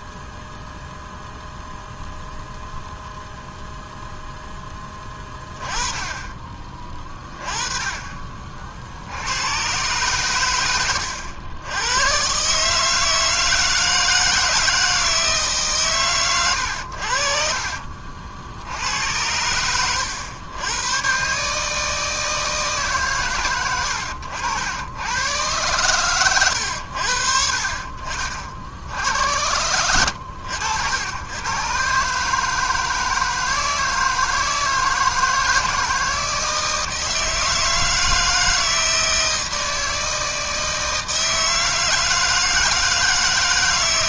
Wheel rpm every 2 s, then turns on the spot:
0, 0, 10, 30, 60, 100, 150, 160, 90, 80, 110, 150, 100, 90, 80, 100, 160, 160, 160, 160, 160, 160.
none